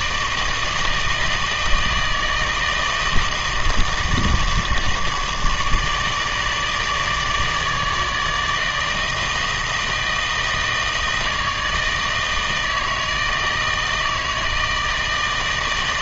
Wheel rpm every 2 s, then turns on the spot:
160, 160, 160, 150, 160, 160, 160, 160.
none